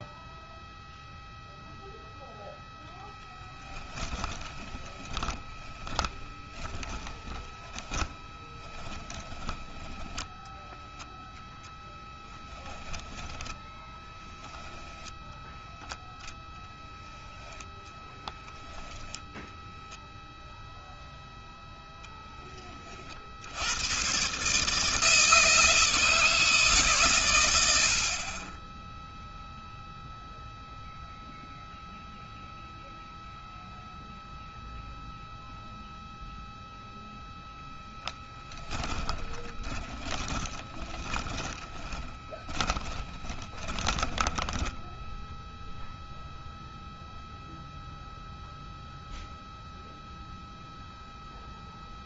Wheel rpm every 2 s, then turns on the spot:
0, 0, 30, 20, 20, 10, 10, 10, 0, 10, 0, 10, 130, 160, 50, 0, 0, 0, 0, 10, 20, 20, 10, 0, 0, 0.
4-10 38-46